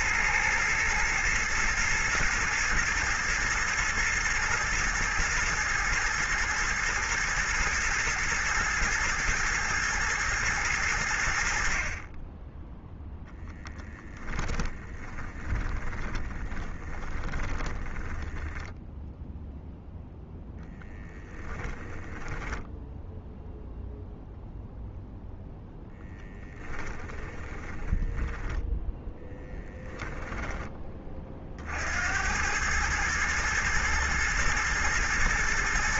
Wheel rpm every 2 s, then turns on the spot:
110, 110, 120, 120, 110, 90, 0, 20, 30, 10, 10, 10, 0, 20, 10, 20, 110, 110.
14-18 20-24 26-30